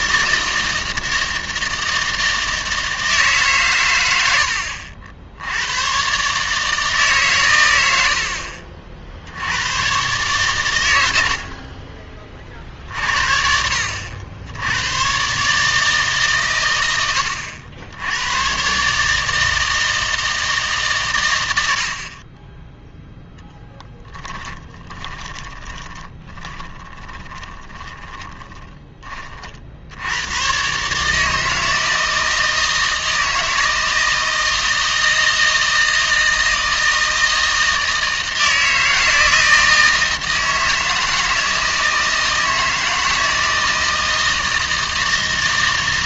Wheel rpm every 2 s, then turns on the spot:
160, 160, 80, 150, 50, 120, 40, 90, 110, 130, 150, 10, 20, 20, 20, 130, 160, 160, 160, 160, 160, 160, 160.
24-30